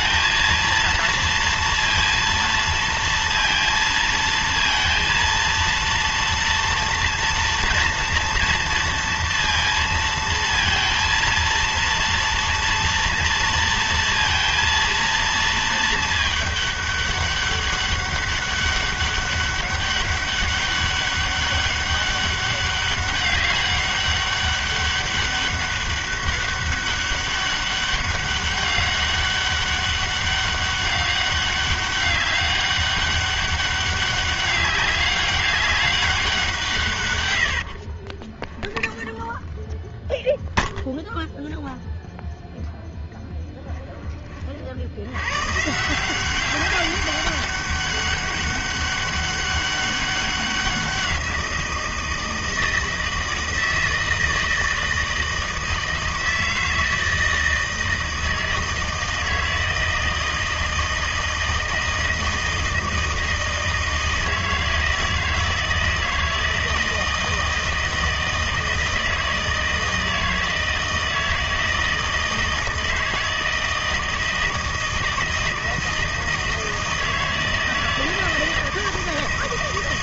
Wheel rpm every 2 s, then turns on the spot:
230, 230, 230, 230, 230, 230, 230, 230, 210, 200, 200, 200, 200, 200, 200, 200, 200, 200, 160, 10, 0, 0, 50, 200, 200, 180, 160, 160, 160, 160, 160, 160, 160, 160, 160, 160, 160, 160, 160, 160.
38-40